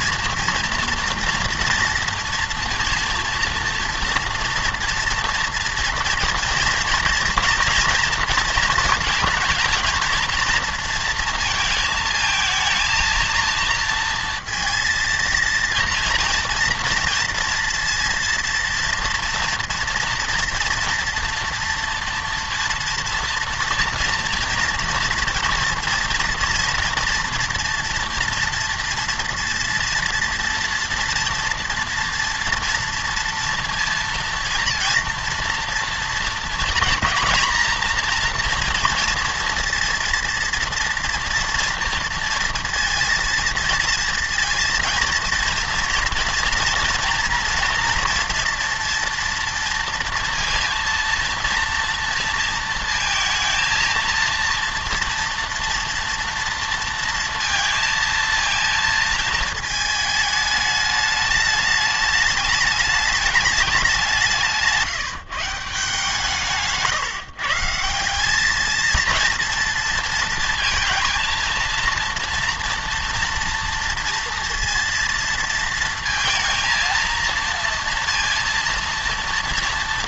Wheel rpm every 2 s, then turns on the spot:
230, 230, 230, 230, 230, 230, 220, 230, 230, 230, 230, 230, 230, 230, 230, 230, 230, 230, 230, 240, 230, 230, 230, 230, 240, 230, 230, 230, 230, 230, 210, 210, 170, 150, 220, 230, 240, 230, 230, 230.
64-66